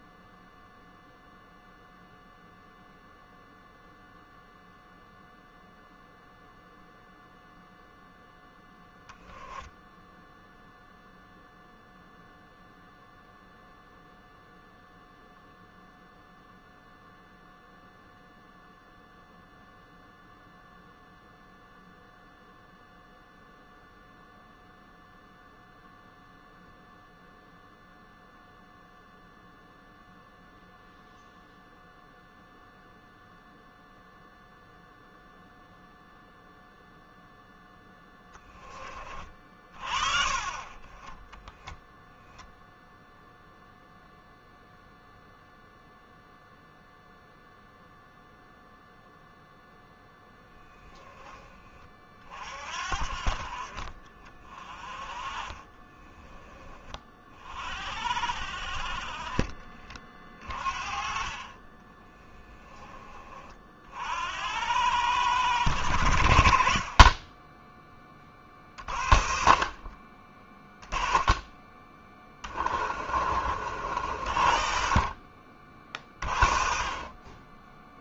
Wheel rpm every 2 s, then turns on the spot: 0, 0, 0, 0, 20, 0, 0, 0, 0, 0, 0, 0, 0, 0, 0, 0, 0, 0, 0, 20, 20, 0, 0, 0, 0, 20, 50, 30, 20, 40, 40, 20, 90, 30, 40, 20, 40, 50, 40.
8-10 54-56 72-74